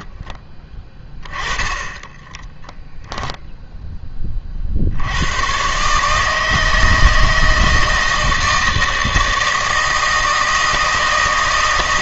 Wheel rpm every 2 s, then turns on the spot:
20, 10, 60, 160, 160, 160.
2-4